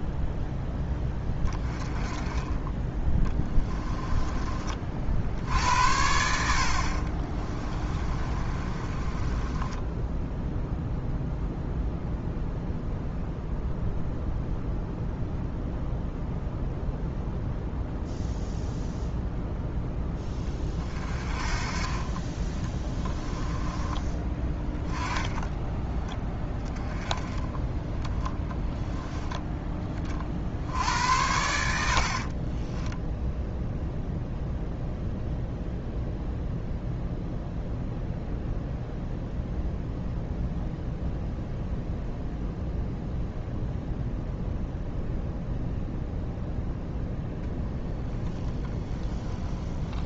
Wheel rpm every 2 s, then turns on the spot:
10, 20, 40, 60, 30, 10, 0, 0, 0, 0, 20, 20, 10, 20, 10, 70, 20, 0, 0, 0, 0, 0, 0, 0, 10.
8-10 24-26 32-34 48-50